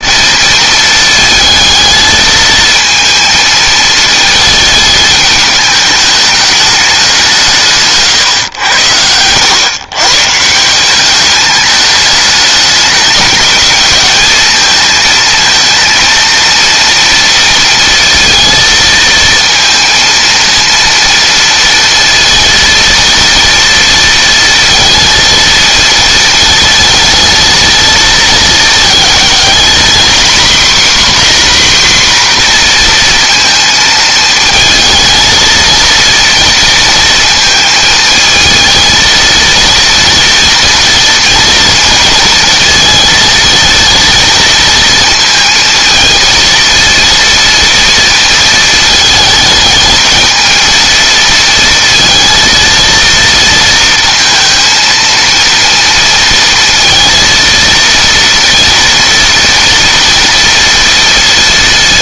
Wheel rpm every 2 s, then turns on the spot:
220, 220, 220, 200, 80, 190, 210, 220, 230, 230, 230, 230, 230, 220, 220, 270, 230, 230, 230, 230, 230, 230, 230, 230, 220, 220, 230, 230, 230, 230, 230.
none